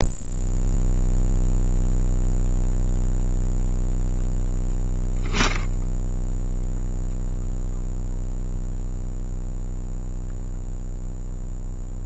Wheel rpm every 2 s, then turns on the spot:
0, 0, 10, 0, 0, 0.
none